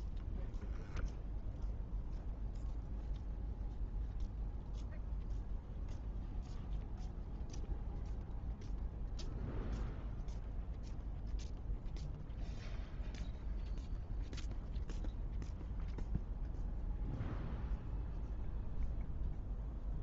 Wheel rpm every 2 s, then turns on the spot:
0, 0, 0, 0, 0, 0, 0, 0, 0, 0.
none